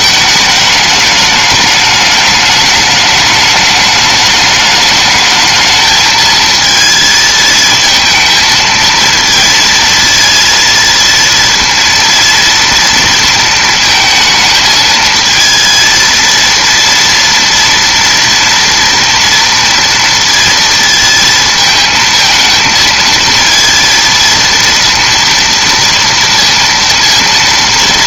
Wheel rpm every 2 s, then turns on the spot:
220, 210, 210, 220, 230, 230, 230, 220, 230, 230, 230, 220, 230, 230.
none